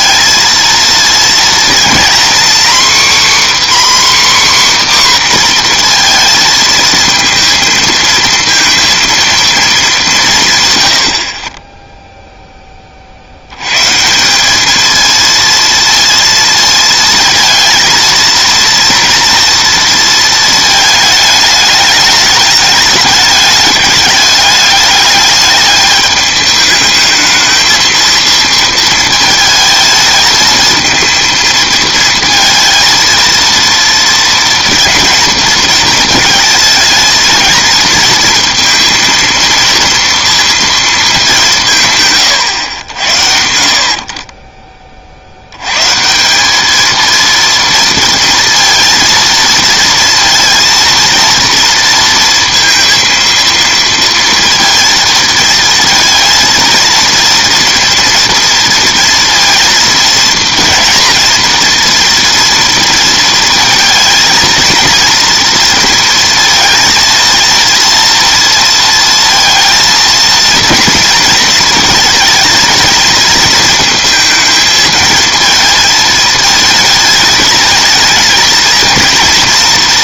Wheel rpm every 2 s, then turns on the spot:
230, 260, 270, 220, 230, 130, 10, 210, 230, 230, 220, 210, 200, 210, 230, 220, 230, 230, 220, 230, 230, 100, 30, 210, 230, 230, 230, 230, 230, 230, 230, 230, 230, 230, 230, 230, 220, 220, 220, 220.
none